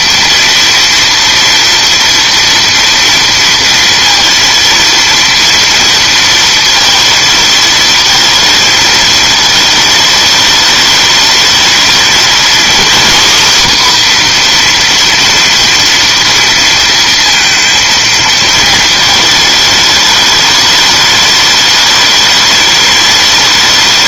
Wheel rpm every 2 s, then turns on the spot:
230, 230, 230, 230, 220, 210, 240, 250, 230, 220, 210, 210.
none